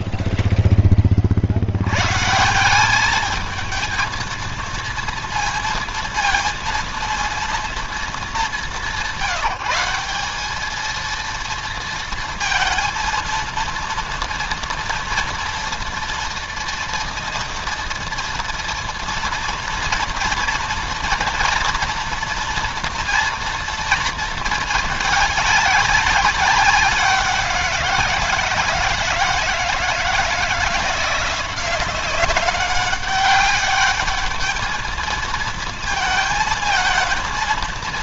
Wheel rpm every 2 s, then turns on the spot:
20, 190, 230, 230, 200, 220, 230, 240, 230, 240, 230, 240, 220, 190, 170, 170, 200, 220, 220.
none